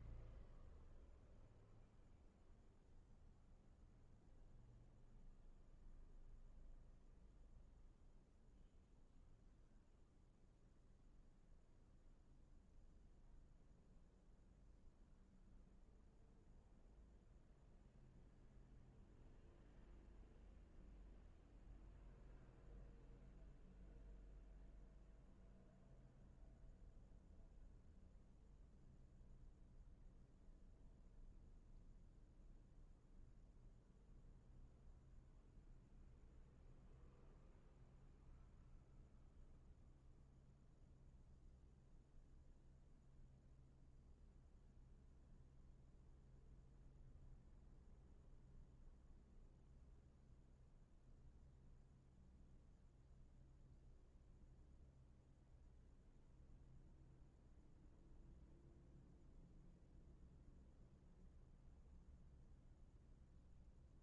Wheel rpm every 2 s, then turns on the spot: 0, 0, 0, 0, 0, 0, 0, 0, 0, 0, 0, 0, 0, 0, 0, 0, 0, 0, 0, 0, 0, 0, 0, 0, 0, 0, 0, 0, 0, 0, 0, 0.
none